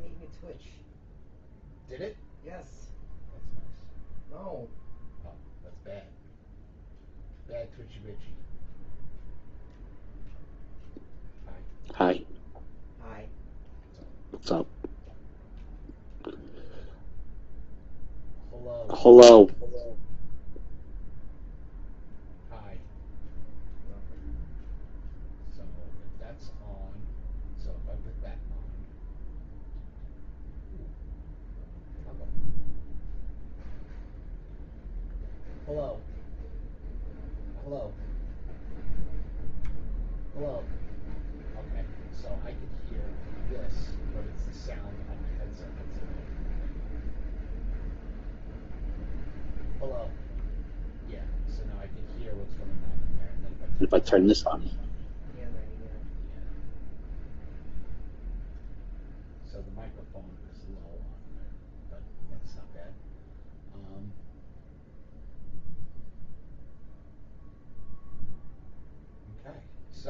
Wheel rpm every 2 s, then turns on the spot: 0, 0, 0, 0, 0, 0, 0, 0, 0, 0, 0, 0, 0, 0, 0, 0, 0, 0, 0, 0, 0, 0, 0, 0, 0, 0, 0, 0, 0, 0, 0, 0, 0, 0, 0.
none